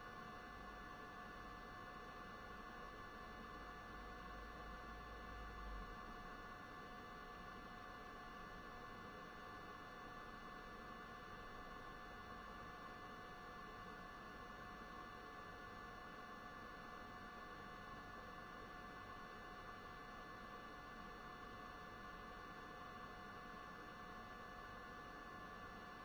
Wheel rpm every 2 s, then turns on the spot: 0, 0, 0, 0, 0, 0, 0, 0, 0, 0, 0, 0, 0.
none